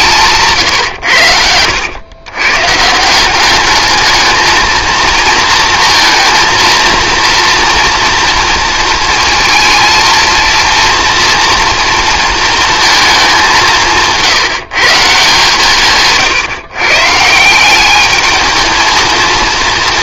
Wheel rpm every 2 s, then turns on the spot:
140, 140, 220, 230, 230, 230, 230, 160, 130, 220.
none